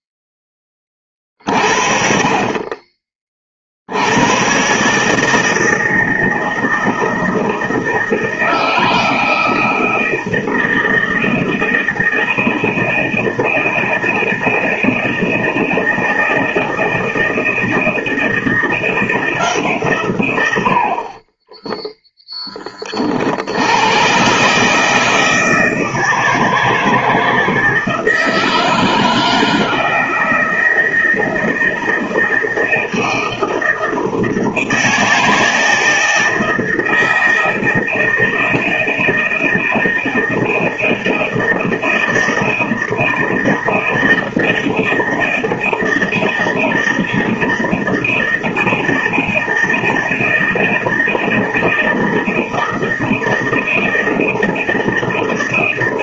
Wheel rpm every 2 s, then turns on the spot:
10, 40, 110, 160, 160, 160, 160, 160, 160, 160, 90, 10, 130, 160, 160, 160, 160, 160, 160, 160, 160, 160, 160, 160, 160, 160, 160, 160.
none